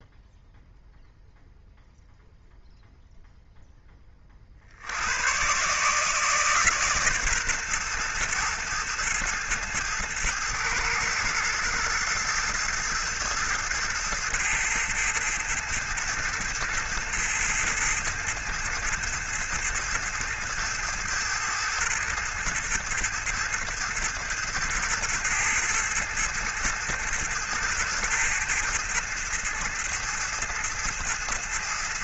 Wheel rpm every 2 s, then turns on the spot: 0, 0, 60, 150, 110, 110, 110, 110, 110, 110, 110, 110, 110, 110, 110, 110.
none